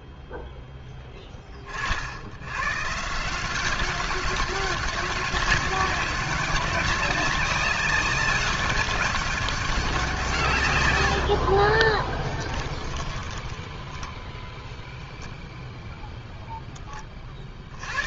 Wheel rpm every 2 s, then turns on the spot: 10, 170, 200, 200, 200, 30, 10, 0, 70.
10-14